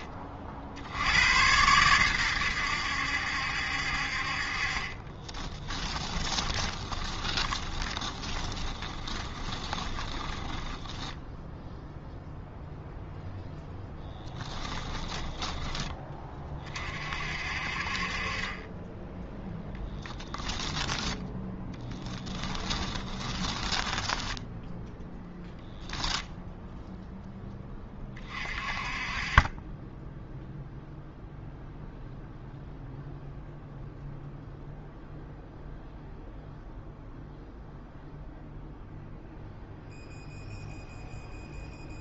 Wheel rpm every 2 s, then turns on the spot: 80, 80, 30, 20, 20, 10, 0, 10, 40, 10, 10, 20, 0, 0, 30, 0, 0, 0, 0, 0, 0.
4-12 14-16 22-24